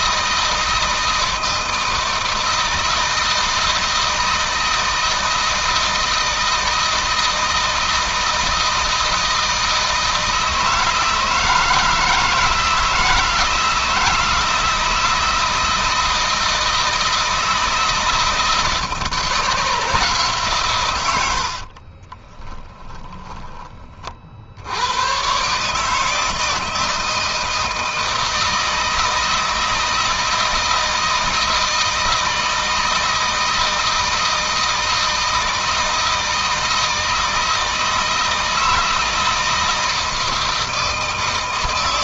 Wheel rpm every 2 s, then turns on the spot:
160, 160, 160, 160, 160, 160, 160, 160, 160, 160, 110, 10, 110, 160, 160, 160, 160, 160, 160, 160, 160.
20-22